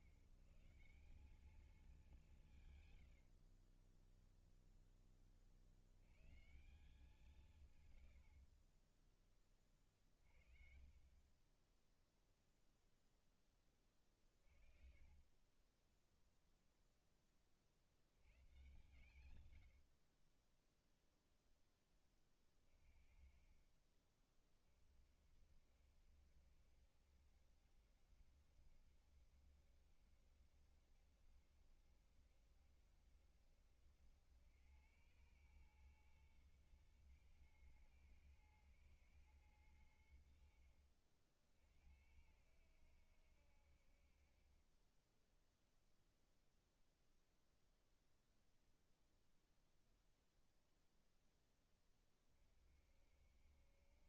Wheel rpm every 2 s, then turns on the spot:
160, 170, 10, 140, 80, 40, 0, 40, 0, 100, 30, 20, 30, 70, 70, 70, 70, 90, 110, 110, 80, 70, 40, 0, 0, 0, 30.
4-6 14-16